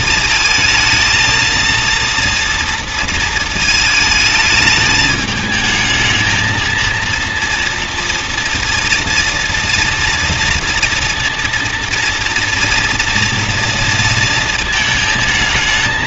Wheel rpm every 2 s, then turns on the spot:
220, 230, 220, 230, 230, 230, 240, 220.
none